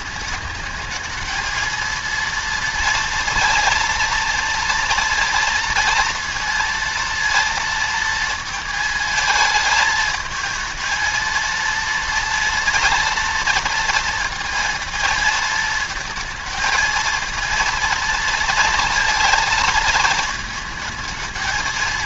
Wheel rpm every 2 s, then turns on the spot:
220, 230, 230, 230, 220, 230, 230, 230, 230, 230, 220.
none